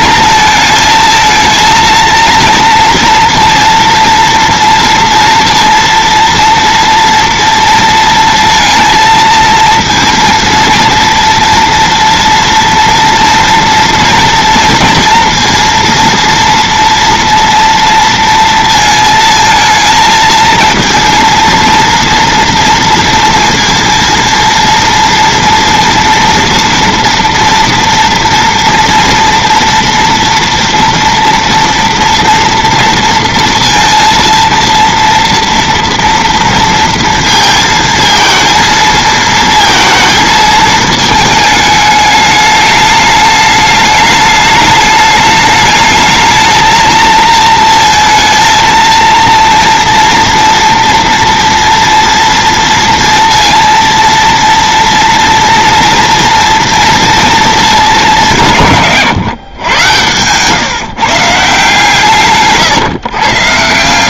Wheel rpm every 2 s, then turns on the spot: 230, 230, 230, 230, 230, 230, 240, 230, 230, 230, 230, 230, 230, 230, 230, 230, 230, 230, 230, 230, 220, 210, 210, 220, 230, 240, 230, 230, 230, 150, 150, 140.
none